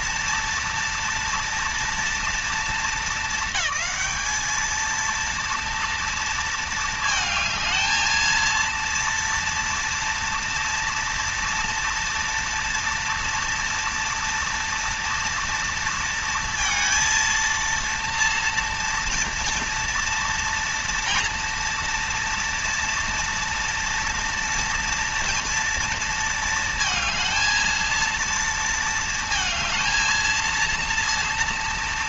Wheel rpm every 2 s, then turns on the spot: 230, 210, 230, 220, 230, 230, 230, 240, 230, 230, 230, 230, 230, 230, 220, 230.
none